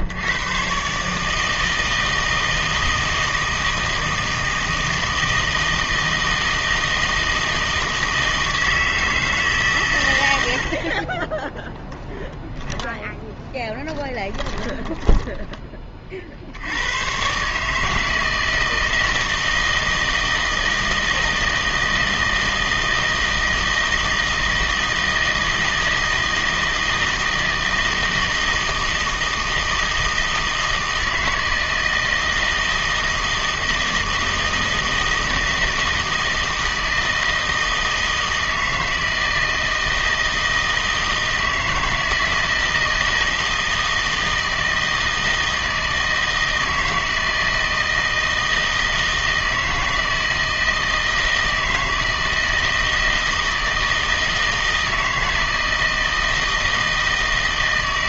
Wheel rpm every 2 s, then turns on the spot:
120, 160, 160, 160, 160, 70, 20, 10, 80, 160, 160, 160, 160, 160, 160, 160, 160, 160, 160, 160, 160, 160, 160, 160, 160, 160, 160, 160, 160.
12-16